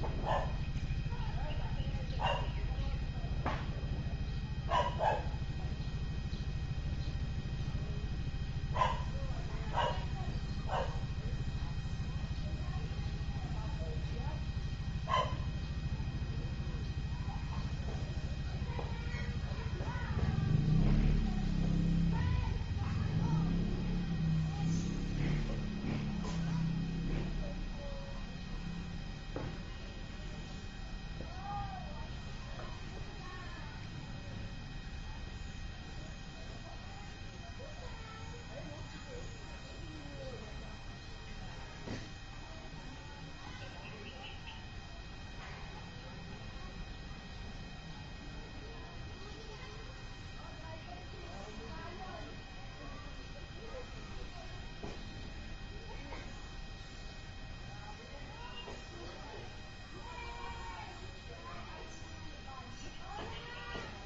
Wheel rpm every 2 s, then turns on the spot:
0, 0, 0, 0, 0, 0, 0, 0, 0, 0, 0, 0, 0, 0, 0, 0, 0, 0, 0, 0, 0, 0, 0, 0, 0, 0, 0, 0, 0, 0, 0, 0.
none